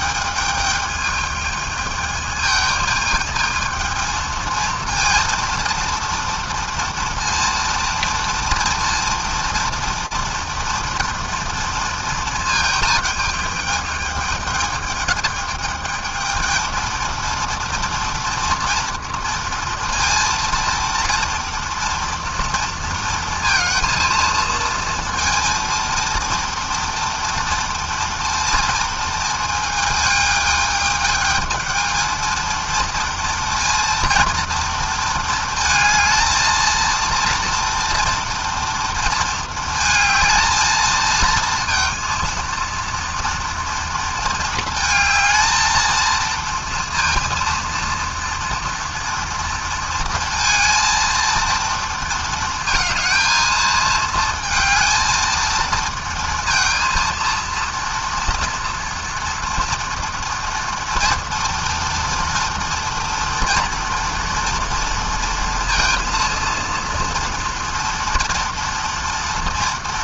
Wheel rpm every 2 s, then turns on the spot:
220, 220, 230, 240, 230, 230, 220, 220, 220, 230, 230, 230, 220, 230, 230, 210, 220, 230, 220, 230, 220, 230, 220, 230, 230, 230, 220, 220, 230, 230, 230, 230, 230, 230, 230.
none